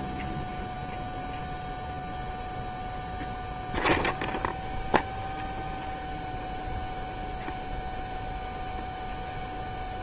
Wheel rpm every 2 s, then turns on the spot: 0, 0, 0, 0, 0.
none